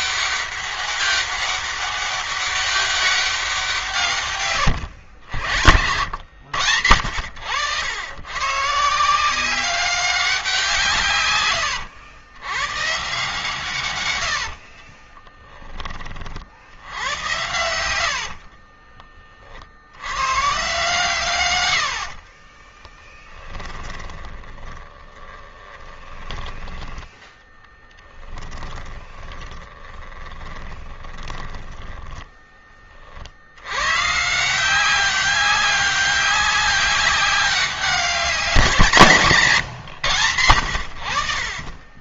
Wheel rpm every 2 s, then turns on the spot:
200, 200, 90, 90, 160, 140, 130, 30, 90, 20, 140, 20, 20, 20, 20, 30, 50, 190, 200, 160, 70.
4-6 14-18 22-32 40-42